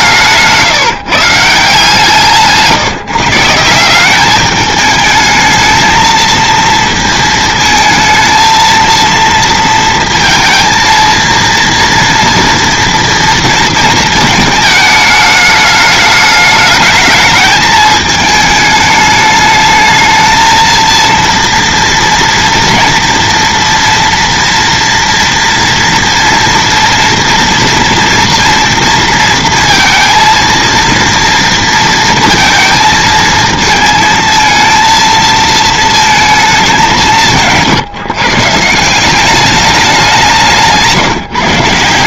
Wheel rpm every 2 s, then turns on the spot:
170, 160, 210, 230, 230, 230, 230, 220, 210, 210, 230, 230, 230, 230, 230, 230, 230, 230, 210, 160, 170.
40-42